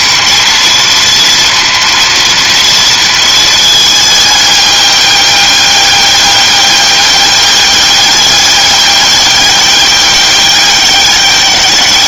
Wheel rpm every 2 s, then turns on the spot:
230, 220, 200, 200, 200, 200.
none